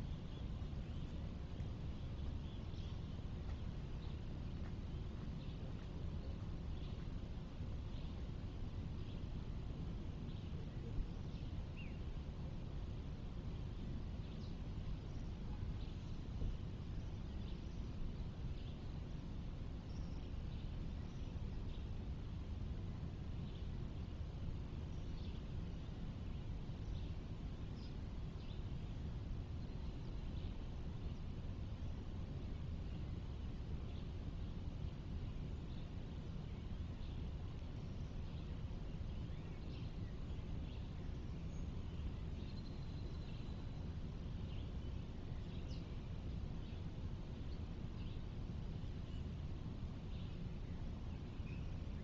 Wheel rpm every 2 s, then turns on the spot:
0, 0, 0, 0, 0, 0, 0, 0, 0, 0, 0, 0, 0, 0, 0, 0, 0, 0, 0, 0, 0, 0, 0, 0, 0, 0.
none